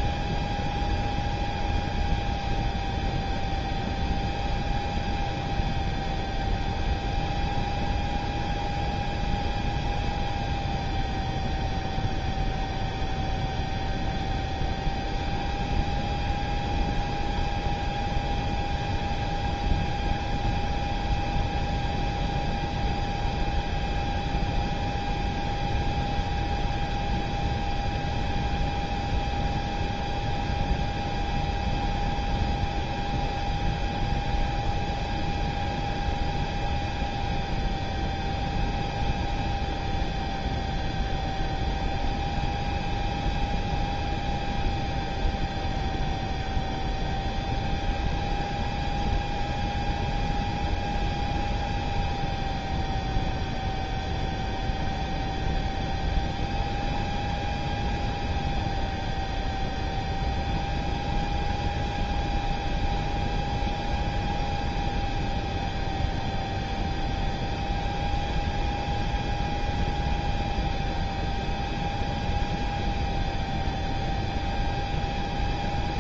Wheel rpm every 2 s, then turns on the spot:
0, 0, 0, 0, 0, 0, 0, 0, 0, 0, 0, 0, 0, 0, 0, 0, 0, 0, 0, 0, 0, 0, 0, 0, 0, 0, 0, 0, 0, 0, 0, 0, 0, 0, 0, 0, 0, 0.
none